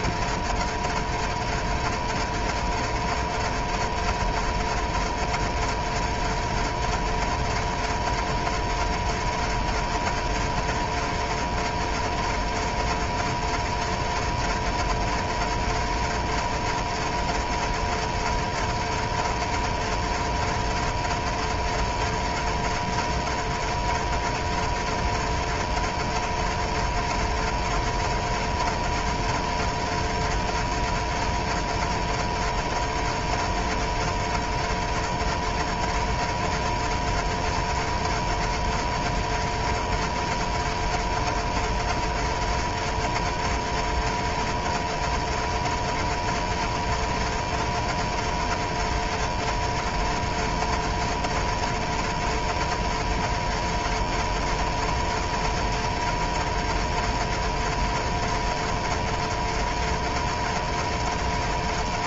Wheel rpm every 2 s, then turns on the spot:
90, 90, 90, 90, 90, 90, 90, 90, 90, 90, 90, 90, 90, 90, 90, 90, 90, 90, 90, 90, 90, 90, 90, 90, 90, 90, 90, 90, 90, 90, 90.
none